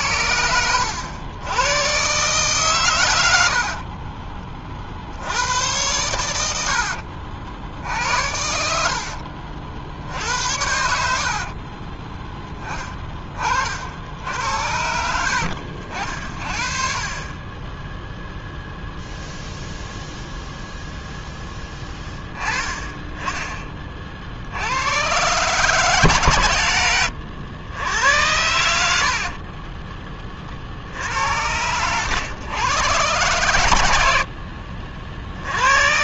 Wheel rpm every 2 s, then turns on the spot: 90, 130, 40, 80, 70, 80, 20, 80, 40, 0, 0, 10, 90, 90, 90, 60, 110, 50.
6-12